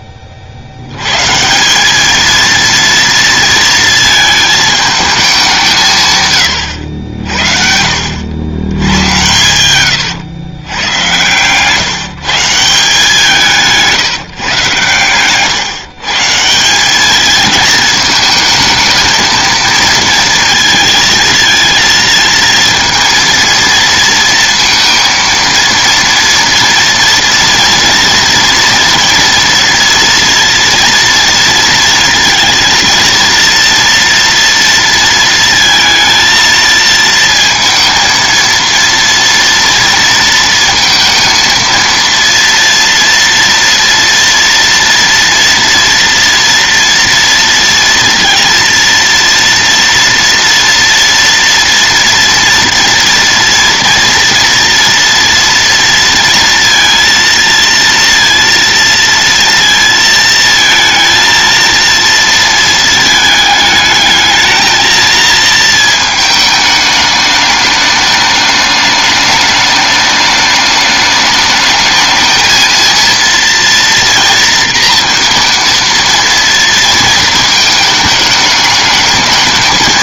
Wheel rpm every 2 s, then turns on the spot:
10, 200, 230, 160, 70, 110, 160, 160, 150, 220, 230, 220, 230, 230, 230, 230, 230, 230, 230, 230, 230, 230, 230, 230, 230, 230, 240, 240, 230, 230, 230, 230, 220, 220, 210, 210, 220, 230, 230, 210.
none